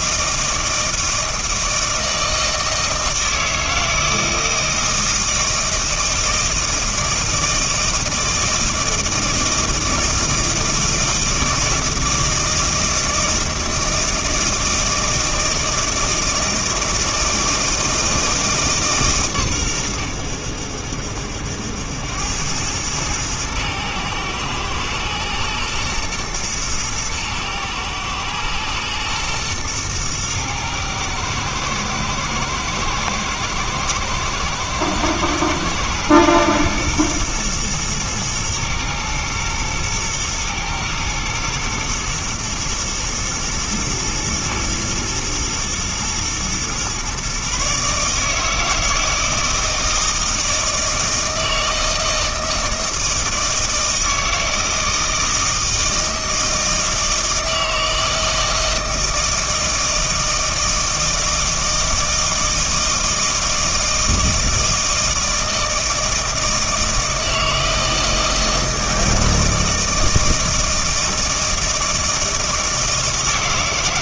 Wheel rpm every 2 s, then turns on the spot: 160, 160, 160, 160, 160, 160, 160, 160, 160, 150, 80, 110, 110, 110, 120, 110, 110, 110, 120, 120, 110, 120, 120, 120, 160, 160, 160, 160, 160, 160, 160, 160, 160, 160, 160, 160, 160.
none